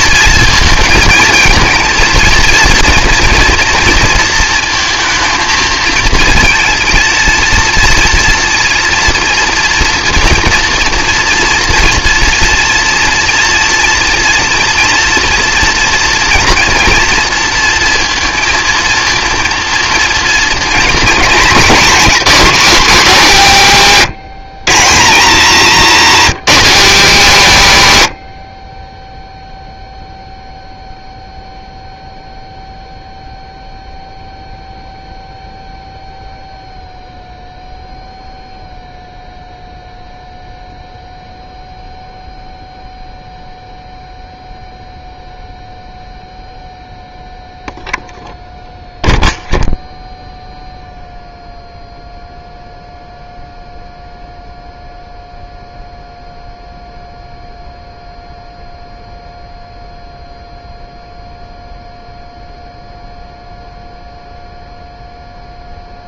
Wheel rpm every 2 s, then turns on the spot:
230, 230, 230, 230, 230, 230, 230, 230, 230, 230, 230, 220, 160, 230, 30, 0, 0, 0, 0, 0, 0, 0, 0, 0, 0, 0, 0, 0, 0, 0, 0, 0, 0.
none